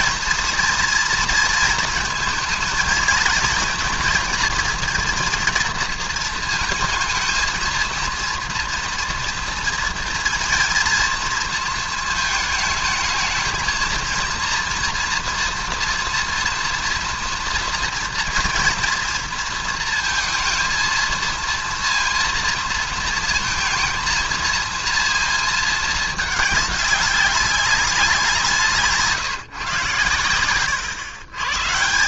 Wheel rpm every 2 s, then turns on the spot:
240, 230, 230, 230, 230, 230, 220, 230, 230, 240, 230, 230, 220, 220, 180, 110.
none